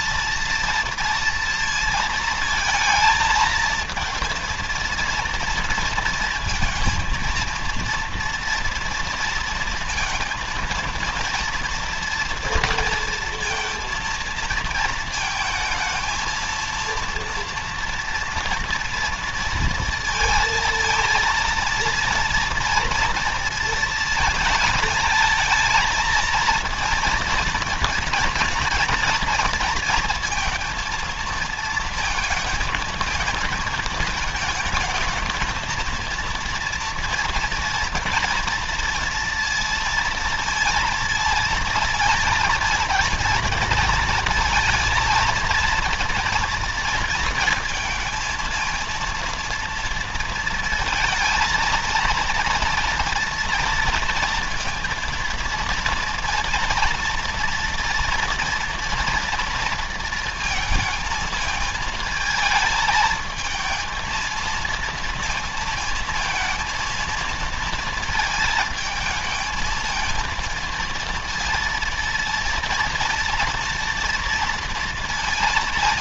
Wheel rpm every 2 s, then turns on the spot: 230, 220, 230, 230, 230, 230, 230, 230, 230, 230, 230, 230, 220, 230, 230, 230, 230, 220, 230, 230, 230, 220, 230, 230, 230, 220, 230, 230, 230, 230, 230, 220, 230, 230, 220, 230, 230, 230.
none